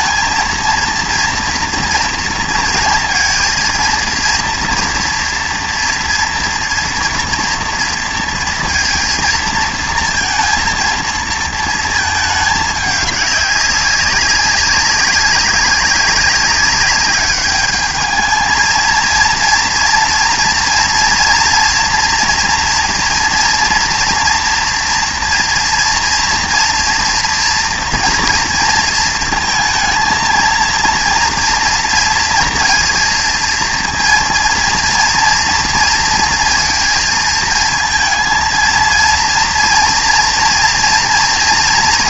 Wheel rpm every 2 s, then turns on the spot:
230, 230, 230, 230, 230, 230, 210, 200, 200, 220, 230, 230, 230, 240, 230, 230, 230, 230, 230, 230, 230.
none